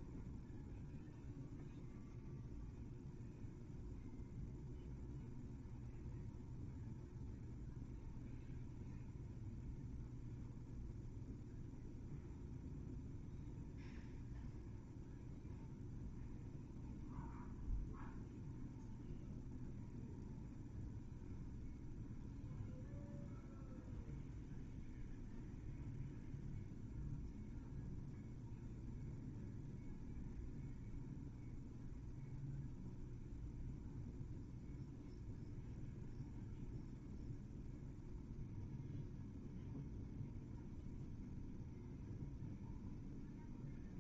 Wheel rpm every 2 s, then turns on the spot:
0, 0, 0, 0, 0, 0, 0, 0, 0, 0, 0, 0, 0, 0, 0, 0, 0, 0, 0, 0, 0, 0.
none